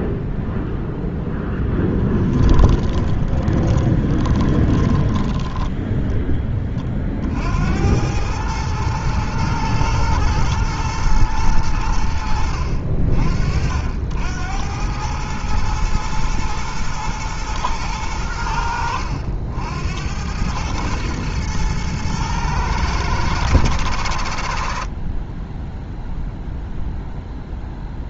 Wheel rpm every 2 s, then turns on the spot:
0, 20, 20, 30, 110, 110, 60, 90, 110, 80, 110, 110, 60, 0.
2-6